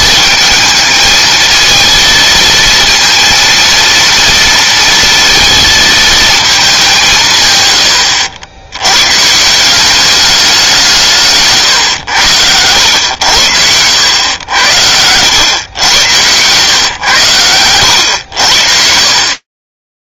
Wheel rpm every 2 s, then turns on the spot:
220, 230, 230, 200, 90, 170, 90, 90, 110, 70.
14-16 18-20